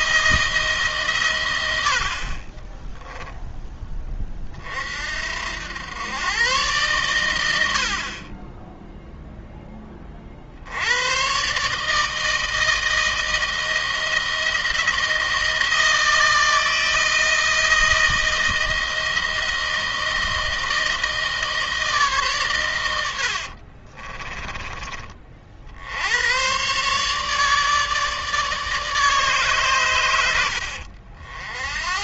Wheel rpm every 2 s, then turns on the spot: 150, 20, 40, 120, 20, 80, 160, 160, 160, 160, 160, 120, 20, 120, 150, 80.
2-4